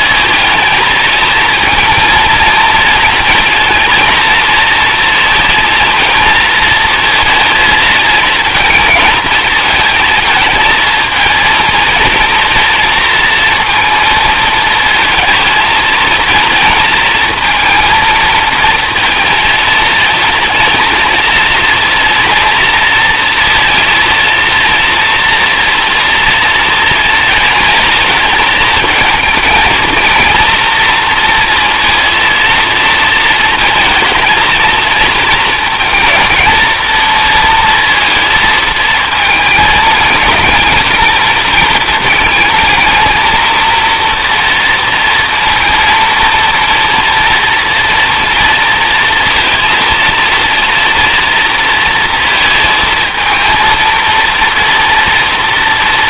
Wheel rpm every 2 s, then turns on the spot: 220, 230, 230, 230, 220, 220, 230, 220, 230, 220, 230, 230, 230, 240, 230, 230, 230, 220, 220, 220, 220, 220, 230, 230, 230, 230, 230, 230.
none